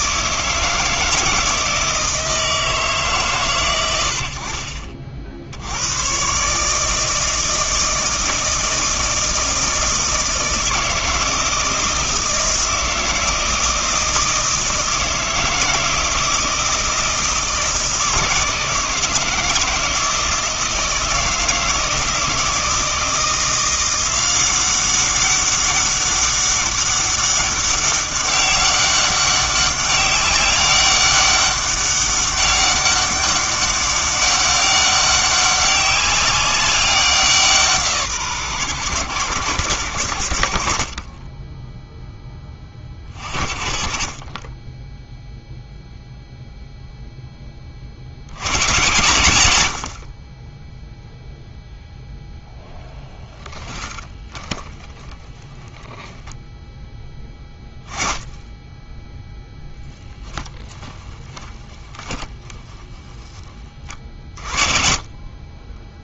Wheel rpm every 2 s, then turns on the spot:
160, 160, 50, 150, 160, 160, 160, 160, 160, 160, 160, 160, 190, 200, 200, 200, 200, 200, 190, 130, 60, 20, 10, 0, 120, 10, 0, 10, 10, 10, 10, 10, 40.
60-64